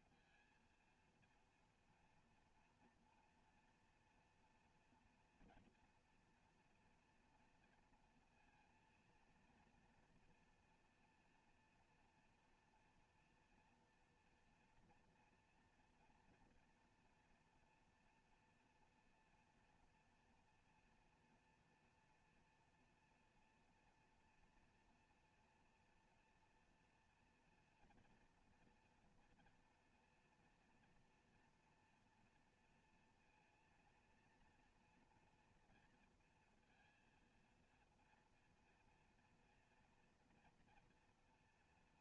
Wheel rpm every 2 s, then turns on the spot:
230, 230, 230, 230, 230, 240, 230, 230, 230, 230, 240, 230, 230, 230, 230, 230, 230, 230, 230, 230, 230.
none